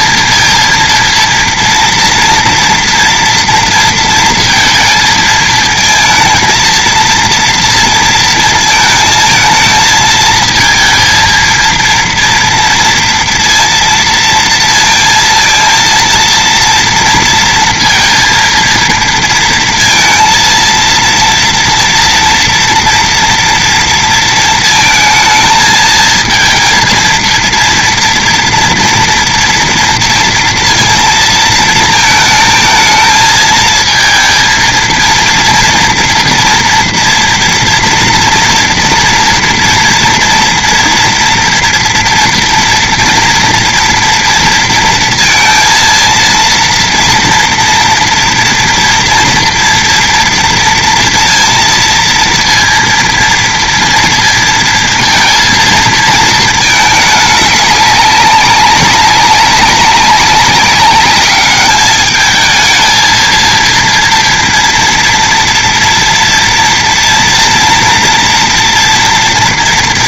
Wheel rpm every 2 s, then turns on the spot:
230, 230, 230, 230, 220, 230, 230, 230, 230, 230, 230, 230, 230, 230, 230, 230, 220, 230, 230, 230, 230, 240, 230, 230, 240, 230, 230, 230, 210, 200, 200, 220, 230, 230, 230.
none